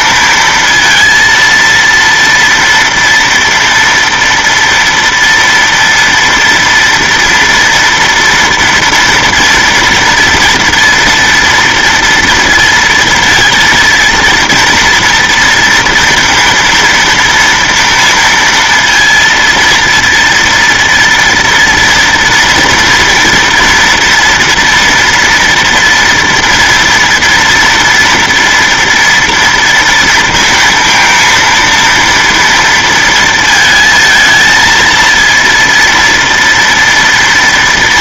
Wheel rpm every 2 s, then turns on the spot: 230, 230, 230, 230, 230, 230, 230, 230, 230, 230, 230, 230, 230, 230, 230, 230, 230, 230, 230.
none